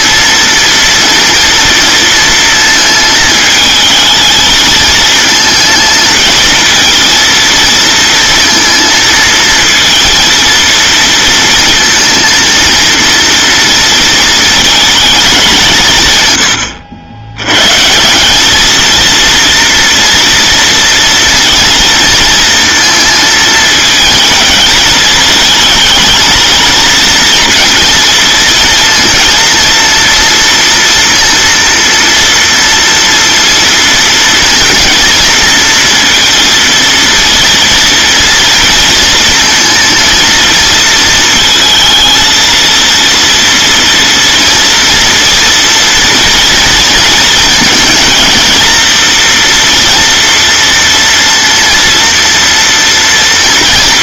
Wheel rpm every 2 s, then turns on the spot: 230, 220, 220, 230, 230, 230, 230, 220, 90, 220, 230, 230, 220, 230, 230, 230, 230, 230, 230, 230, 220, 230, 230, 230, 230, 230, 240.
none